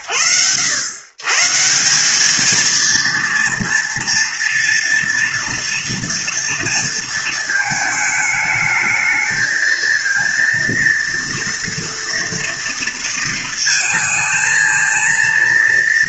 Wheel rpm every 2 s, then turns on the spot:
100, 230, 230, 230, 220, 230, 230, 230.
none